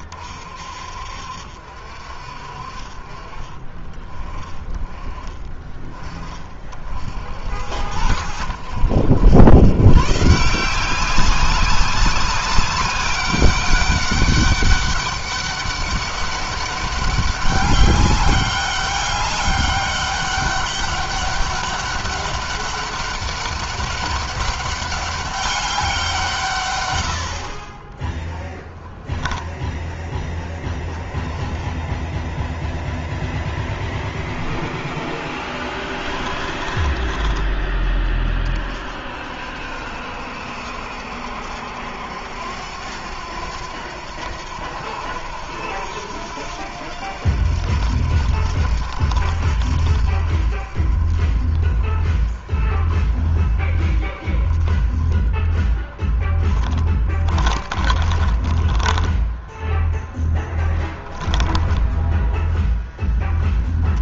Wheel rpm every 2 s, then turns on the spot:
50, 40, 20, 50, 80, 180, 200, 200, 200, 200, 200, 200, 200, 110, 10, 10, 20, 10, 10, 50, 70, 90, 80, 80, 80, 50, 30, 20, 20, 10, 10, 0.
28-30 36-38 56-60